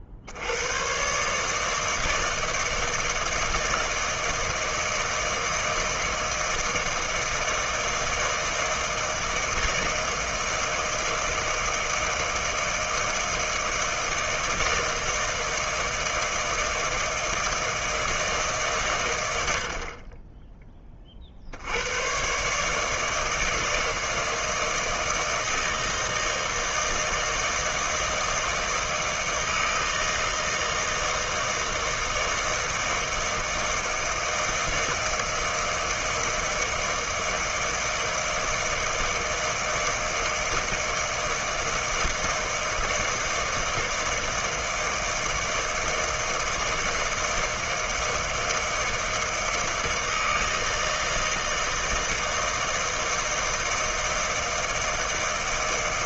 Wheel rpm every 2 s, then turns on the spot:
50, 160, 160, 160, 160, 160, 160, 160, 160, 150, 10, 140, 160, 160, 160, 160, 160, 160, 160, 160, 160, 160, 160, 160, 160, 160, 160, 160.
none